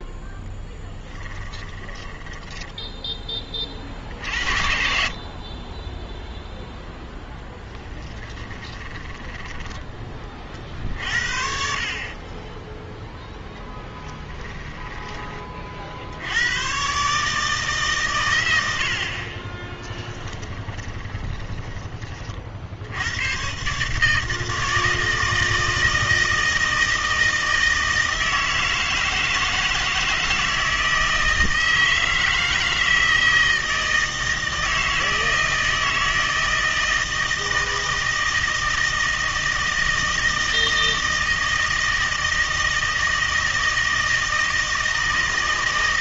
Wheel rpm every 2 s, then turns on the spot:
10, 10, 50, 0, 10, 40, 10, 10, 120, 80, 20, 70, 160, 160, 160, 160, 160, 160, 160, 160, 160, 160, 160.
0-2 8-10 12-16 20-22